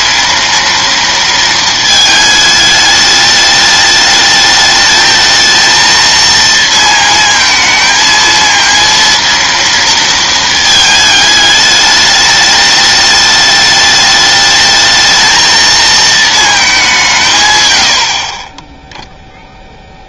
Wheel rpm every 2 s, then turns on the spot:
230, 210, 220, 230, 230, 220, 210, 220, 200, 10.
none